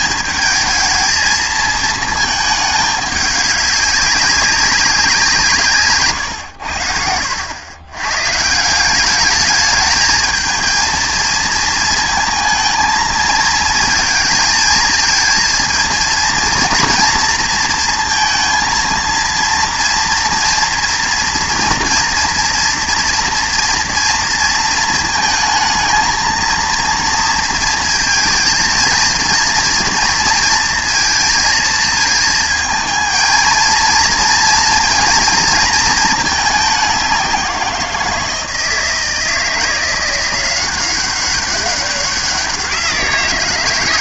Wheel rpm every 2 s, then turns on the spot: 220, 210, 190, 90, 170, 220, 220, 220, 230, 230, 230, 230, 230, 230, 230, 230, 230, 230, 210, 160, 180, 180.
none